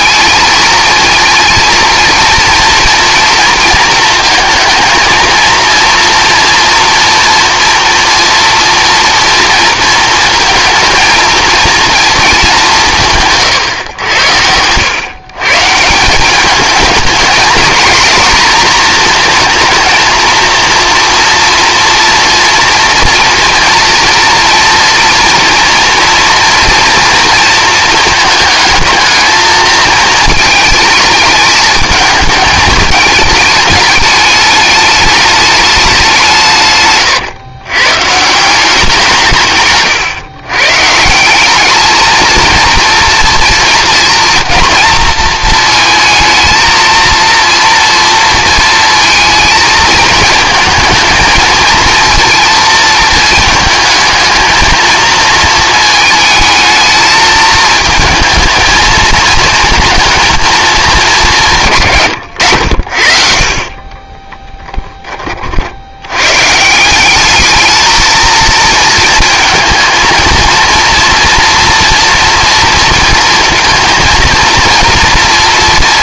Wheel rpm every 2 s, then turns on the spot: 220, 230, 220, 240, 230, 230, 180, 100, 210, 230, 230, 230, 230, 230, 220, 220, 210, 210, 140, 180, 140, 230, 230, 220, 230, 220, 230, 230, 220, 220, 220, 80, 10, 150, 230, 230, 230, 230.
none